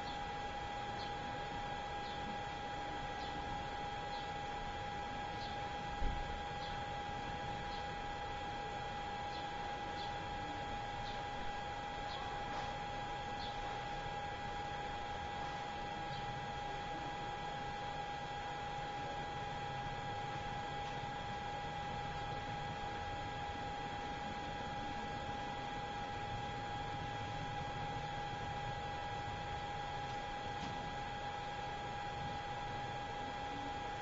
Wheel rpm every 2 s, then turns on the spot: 0, 0, 0, 0, 0, 0, 0, 0, 0, 0, 0, 0, 0, 0, 0, 0, 0.
none